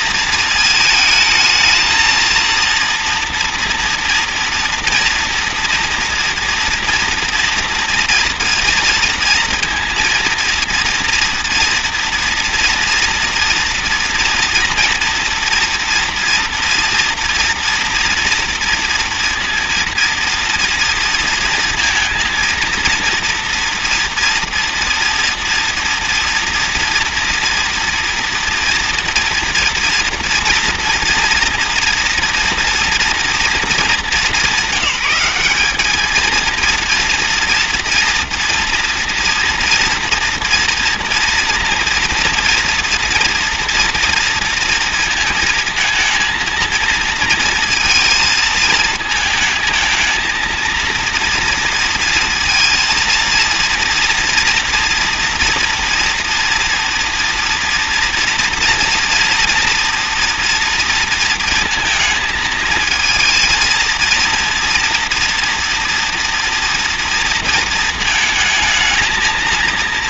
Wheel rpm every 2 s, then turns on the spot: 230, 230, 230, 230, 230, 230, 230, 230, 230, 240, 230, 230, 230, 230, 230, 230, 230, 200, 230, 240, 230, 230, 230, 230, 220, 230, 230, 230, 230, 230, 230, 220, 230, 230, 230.
none